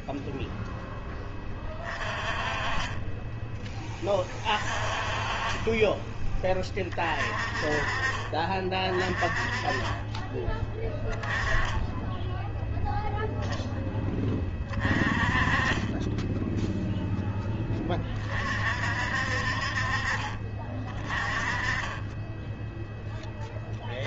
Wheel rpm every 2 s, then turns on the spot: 10, 20, 30, 30, 30, 10, 0, 30, 0, 50, 30, 10.
none